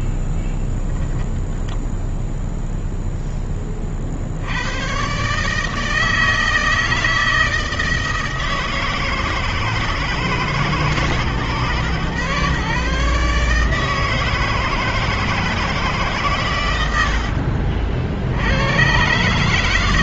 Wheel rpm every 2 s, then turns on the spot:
0, 0, 70, 160, 160, 150, 130, 160, 120, 80.
none